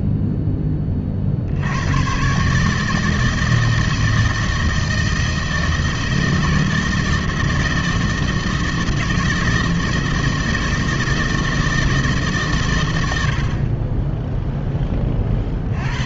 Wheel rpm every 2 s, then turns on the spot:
80, 160, 160, 160, 170, 160, 90, 60.
none